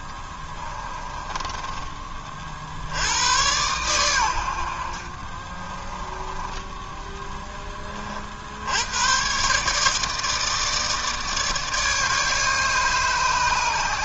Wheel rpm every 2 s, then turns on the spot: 20, 80, 50, 10, 110, 160, 150.
0-2 4-6